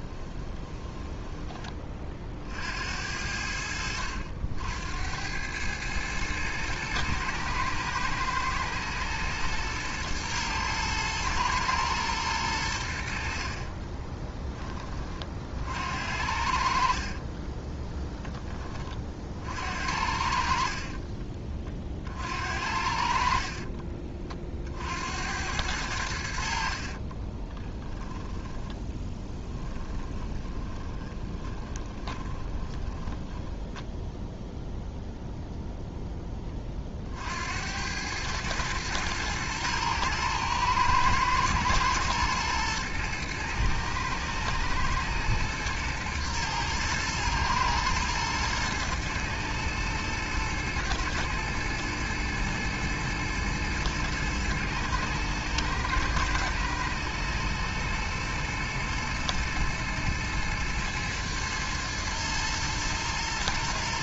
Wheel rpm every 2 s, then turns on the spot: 20, 70, 80, 110, 120, 110, 80, 20, 60, 30, 30, 60, 60, 60, 10, 20, 20, 0, 40, 110, 110, 110, 110, 110, 110, 120, 120, 110, 110, 120, 110, 110.
0-2 16-18 20-22 26-34